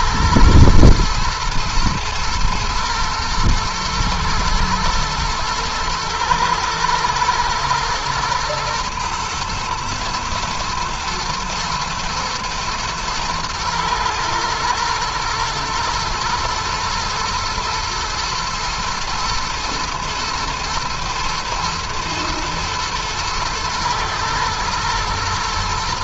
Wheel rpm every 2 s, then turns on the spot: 110, 110, 110, 110, 110, 110, 120, 110, 120, 120, 120, 110, 110.
none